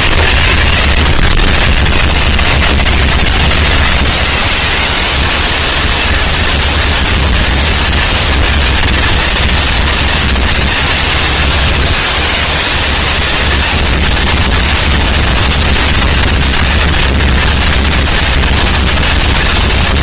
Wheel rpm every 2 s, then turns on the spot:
90, 130, 190, 230, 230, 230, 230, 230, 230, 230.
none